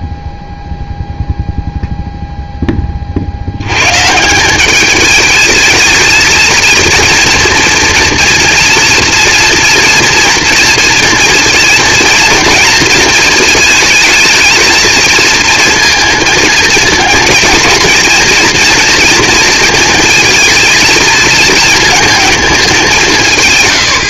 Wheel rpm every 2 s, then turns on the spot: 0, 10, 190, 230, 240, 230, 230, 220, 230, 240, 230, 210.
none